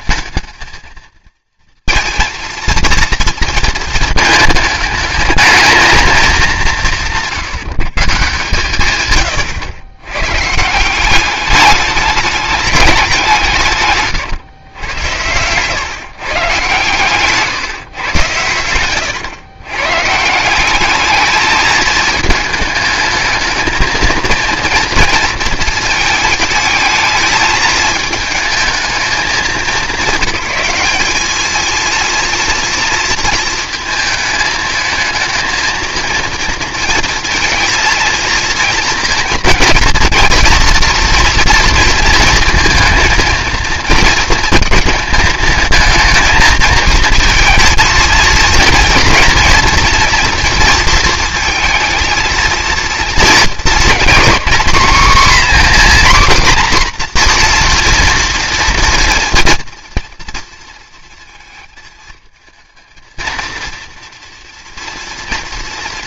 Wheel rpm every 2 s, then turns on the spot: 220, 230, 210, 200, 130, 160, 210, 110, 140, 100, 190, 220, 230, 220, 210, 200, 230, 220, 230, 230, 230, 230, 220, 220, 230, 230, 230, 260, 260, 230, 230, 220, 230.
18-20